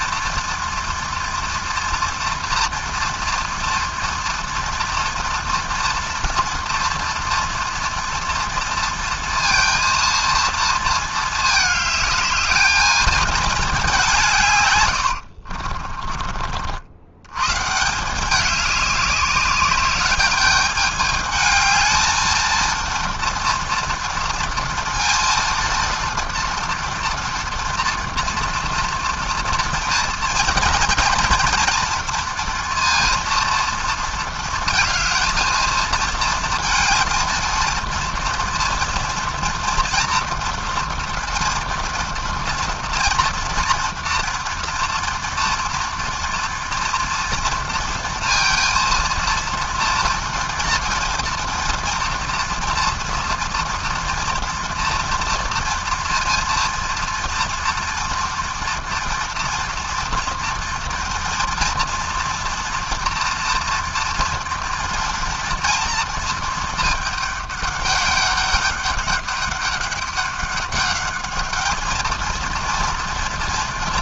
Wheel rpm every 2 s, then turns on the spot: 240, 230, 230, 230, 230, 230, 220, 140, 50, 200, 210, 230, 230, 230, 240, 230, 230, 230, 230, 230, 230, 230, 230, 230, 230, 230, 230, 230, 230, 230, 230, 240, 230, 220, 200, 200, 230.
14-16